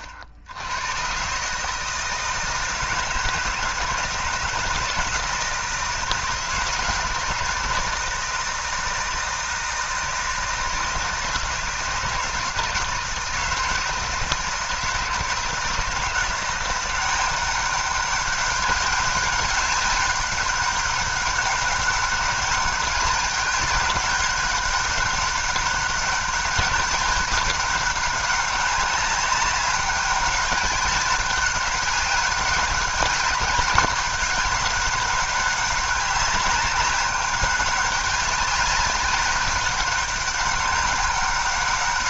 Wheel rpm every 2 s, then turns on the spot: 100, 160, 160, 160, 160, 160, 160, 160, 170, 200, 200, 200, 200, 200, 200, 200, 200, 200, 200, 200, 200.
none